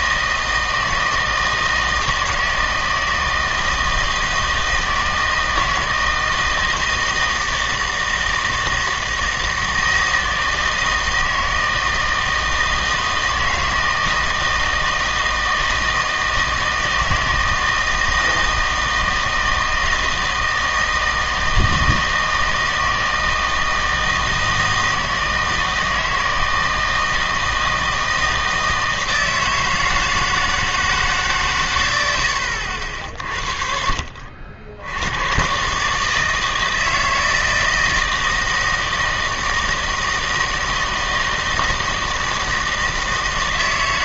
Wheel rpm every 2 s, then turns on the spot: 160, 160, 160, 160, 160, 160, 160, 160, 160, 160, 160, 160, 160, 160, 160, 160, 80, 80, 160, 160, 160, 160.
none